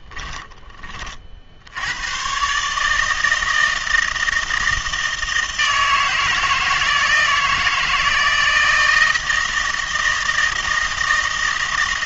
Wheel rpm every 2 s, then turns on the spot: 20, 150, 160, 160, 160, 160.
none